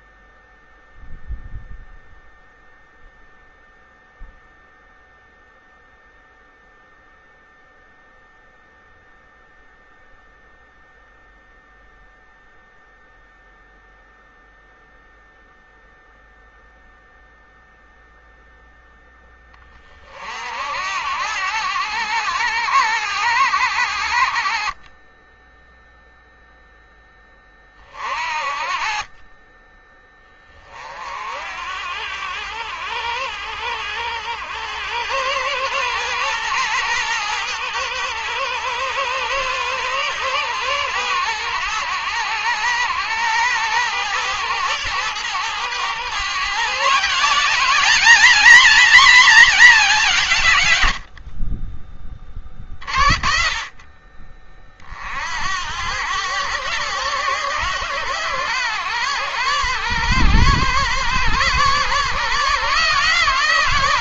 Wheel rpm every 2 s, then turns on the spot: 0, 0, 0, 0, 0, 0, 0, 0, 0, 0, 70, 80, 30, 0, 40, 40, 80, 100, 120, 110, 110, 110, 110, 150, 240, 100, 30, 40, 130, 120, 120, 150.
50-52